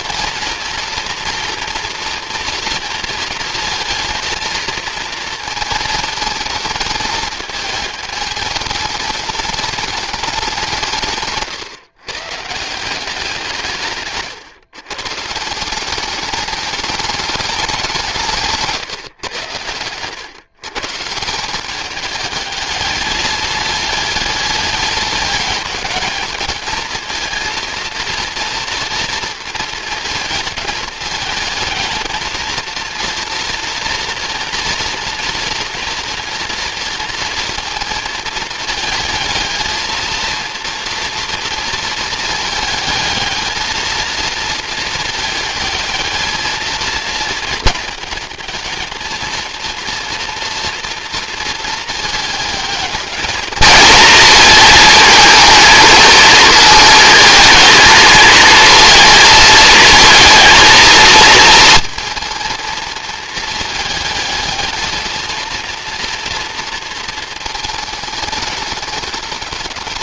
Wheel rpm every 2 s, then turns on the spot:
230, 230, 230, 220, 210, 170, 170, 130, 200, 160, 140, 210, 210, 220, 230, 220, 230, 230, 230, 220, 230, 220, 220, 220, 220, 240, 220, 220, 220, 230, 220, 220, 220, 230, 210.
none